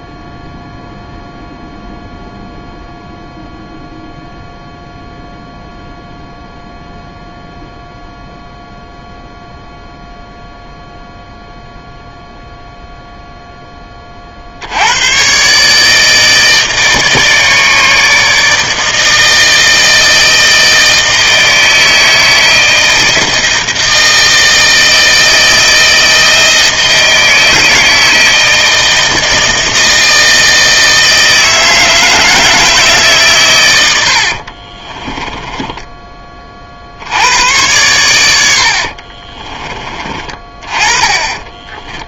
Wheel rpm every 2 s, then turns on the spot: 0, 0, 0, 0, 0, 0, 0, 70, 150, 160, 160, 160, 160, 160, 160, 160, 160, 50, 40, 70, 20.
34-36 38-40